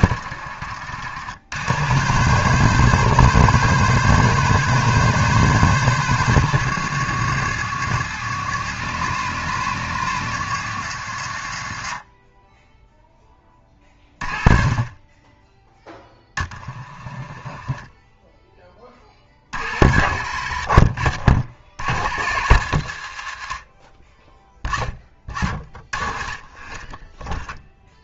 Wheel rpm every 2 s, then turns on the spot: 70, 130, 140, 120, 130, 110, 10, 20, 20, 20, 50, 80, 10, 10.
16-18